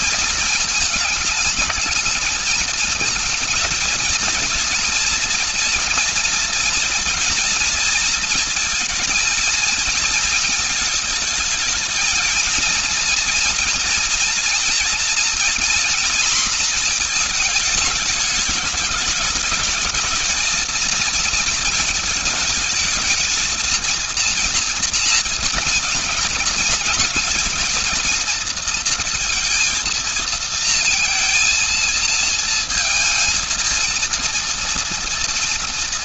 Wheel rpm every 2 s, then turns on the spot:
220, 220, 240, 230, 230, 220, 230, 240, 230, 210, 220, 220, 230, 240, 230, 230, 230, 230.
none